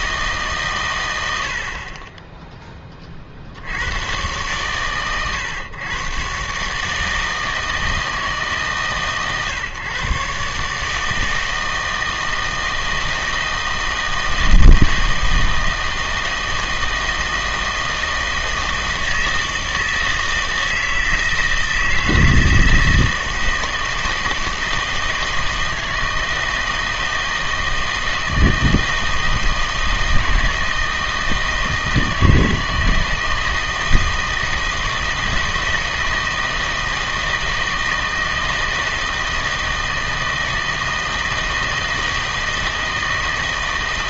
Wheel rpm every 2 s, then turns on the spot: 130, 10, 120, 150, 150, 150, 160, 160, 160, 160, 160, 160, 160, 160, 160, 160, 160, 160, 160, 160, 160, 160.
none